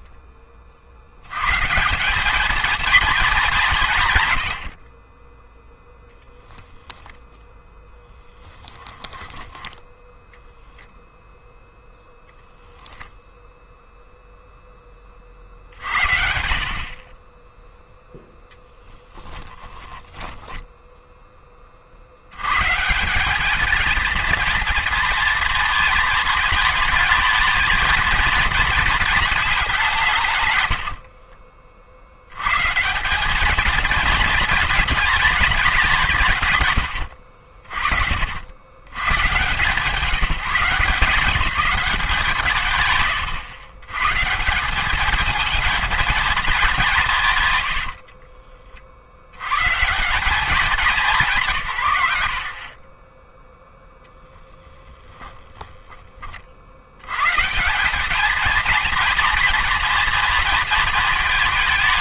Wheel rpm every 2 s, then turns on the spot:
70, 210, 30, 0, 10, 0, 0, 30, 40, 10, 10, 190, 230, 220, 220, 50, 190, 220, 80, 110, 170, 120, 210, 180, 50, 190, 30, 0, 70, 230, 230.
8-10 18-20 30-32 36-38